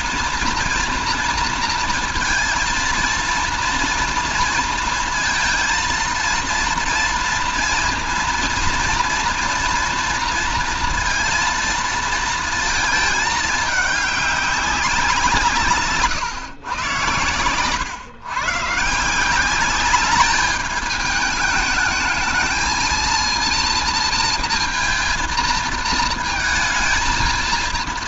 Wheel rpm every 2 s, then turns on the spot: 230, 230, 230, 230, 240, 230, 220, 190, 120, 140, 210, 220, 230, 220.
none